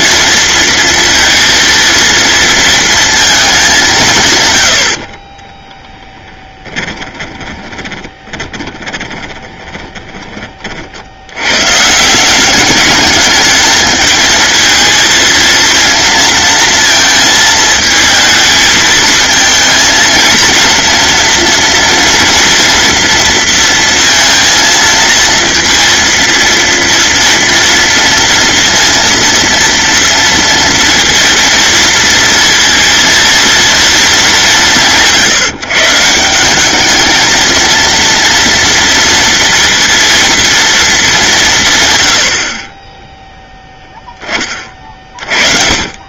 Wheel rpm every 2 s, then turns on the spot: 230, 230, 70, 20, 20, 40, 200, 230, 230, 220, 230, 230, 230, 230, 230, 230, 230, 170, 200, 230, 230, 20, 30.
6-10